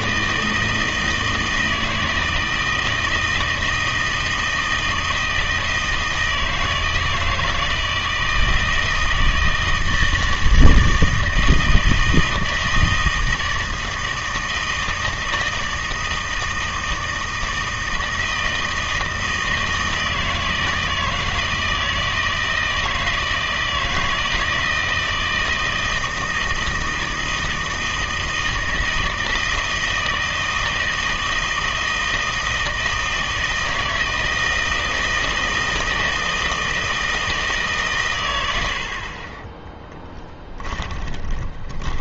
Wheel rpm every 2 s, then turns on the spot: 160, 160, 160, 160, 160, 160, 160, 160, 160, 160, 160, 160, 160, 160, 160, 160, 160, 160, 160, 70, 20.
40-42